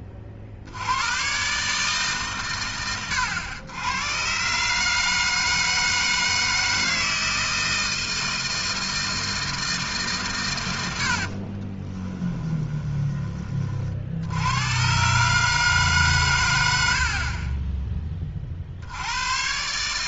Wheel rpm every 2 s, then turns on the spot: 100, 100, 150, 160, 160, 70, 20, 110, 130, 90.
10-12